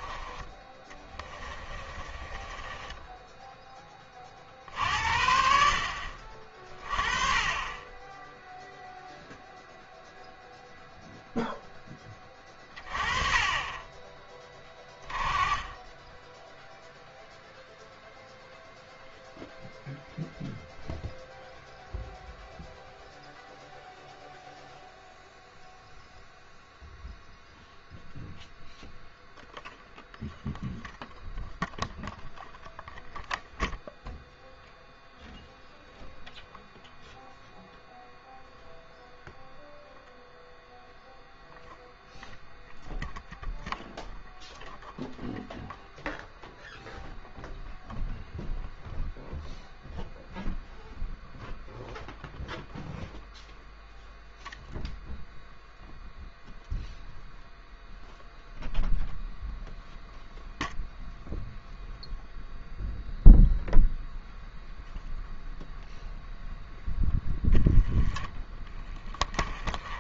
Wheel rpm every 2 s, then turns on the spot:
20, 20, 50, 30, 0, 0, 20, 20, 0, 0, 0, 0, 0, 0, 0, 0, 0, 0, 0, 0, 0, 0, 0, 0, 0, 0, 0, 0, 0, 0, 0, 0, 0, 0, 10.
0-2